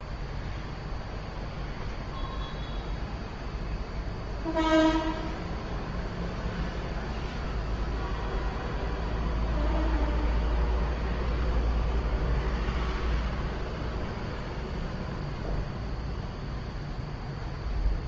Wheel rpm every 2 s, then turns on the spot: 0, 0, 0, 0, 0, 0, 0, 0, 0.
none